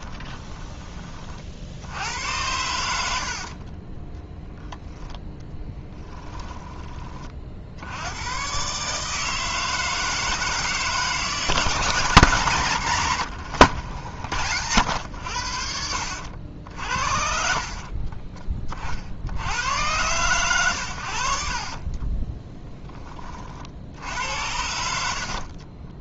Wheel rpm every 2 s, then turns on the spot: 10, 90, 10, 20, 130, 160, 150, 80, 70, 30, 100, 10, 70.
6-8